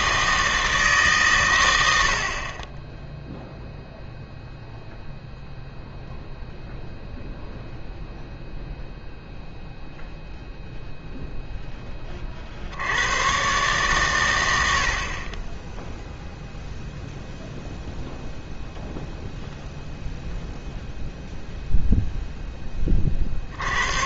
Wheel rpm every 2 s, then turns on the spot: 150, 10, 0, 0, 0, 0, 70, 80, 0, 0, 0, 20.
none